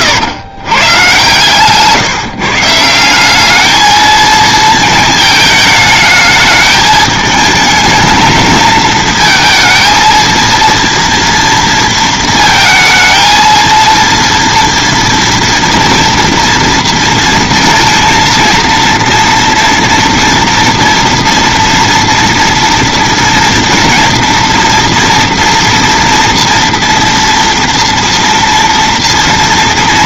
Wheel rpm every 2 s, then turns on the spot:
120, 150, 220, 220, 220, 230, 230, 230, 230, 230, 240, 230, 230, 230, 230.
none